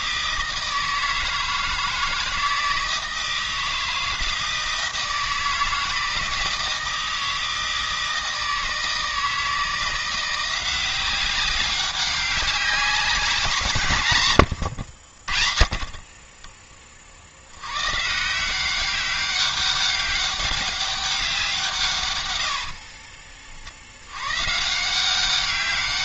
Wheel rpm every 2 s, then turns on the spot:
160, 160, 160, 160, 160, 180, 190, 100, 40, 190, 200, 70, 150.
14-16 22-24